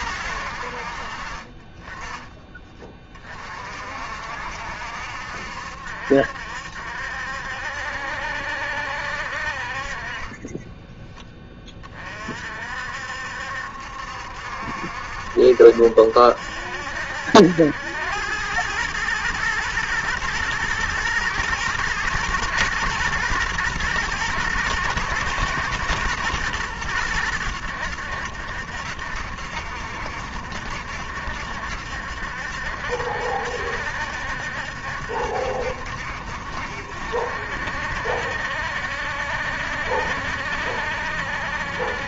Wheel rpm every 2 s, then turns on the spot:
70, 20, 60, 60, 70, 20, 50, 70, 70, 100, 110, 110, 110, 110, 70, 70, 70, 70, 60, 70, 70.
10-12